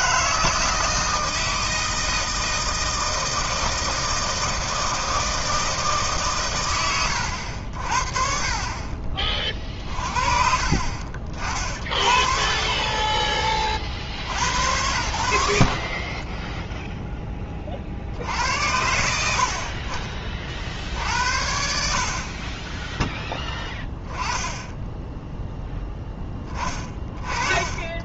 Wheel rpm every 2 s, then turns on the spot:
160, 160, 160, 110, 40, 50, 30, 80, 10, 80, 40, 20, 10, 20.
16-18